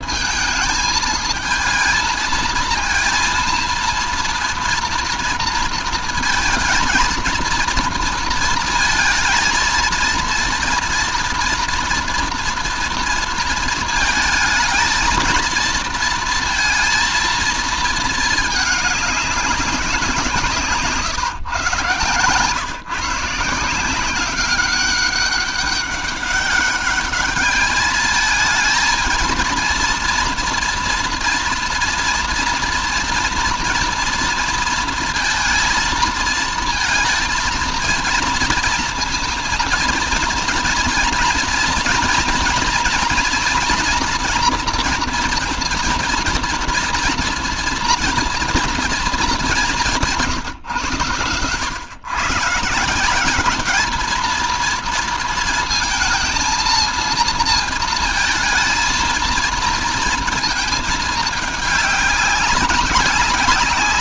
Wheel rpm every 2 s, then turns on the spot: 220, 230, 230, 230, 230, 230, 230, 220, 230, 210, 150, 140, 190, 200, 220, 230, 230, 230, 230, 230, 230, 230, 230, 230, 230, 130, 170, 230, 230, 230, 220, 190.
none